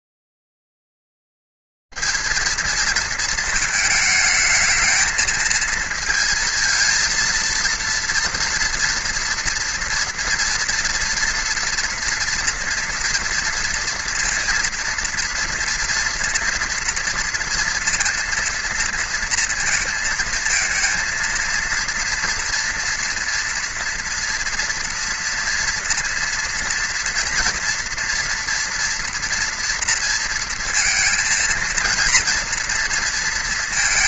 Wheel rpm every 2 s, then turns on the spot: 30, 210, 220, 230, 230, 230, 230, 230, 230, 230, 230, 230, 230, 230, 240, 230, 230.
none